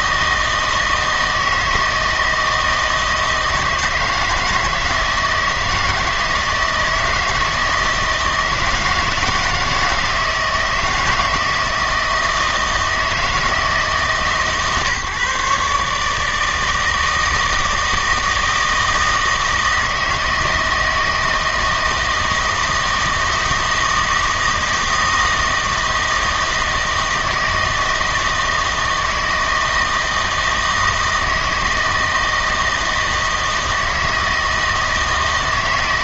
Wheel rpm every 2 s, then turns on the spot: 160, 160, 160, 160, 160, 160, 160, 150, 160, 160, 160, 160, 160, 160, 160, 160, 160, 160.
none